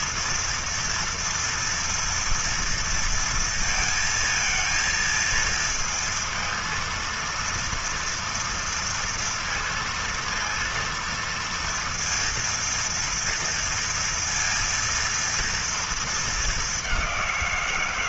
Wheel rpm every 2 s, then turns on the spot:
230, 230, 230, 230, 230, 230, 230, 230, 200.
none